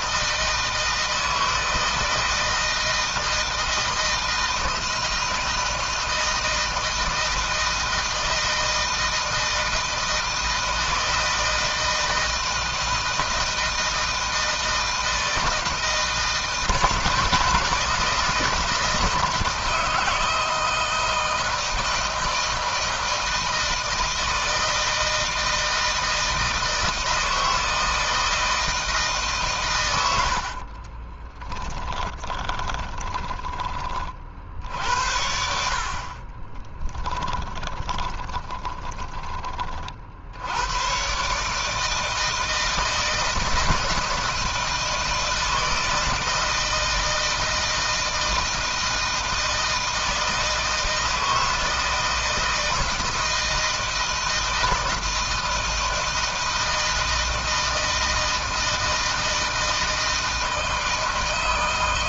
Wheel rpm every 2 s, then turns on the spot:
160, 160, 160, 160, 160, 160, 160, 160, 160, 170, 160, 160, 160, 160, 160, 70, 20, 60, 30, 10, 90, 160, 160, 160, 160, 160, 160, 160, 160, 160, 160.
30-34 36-40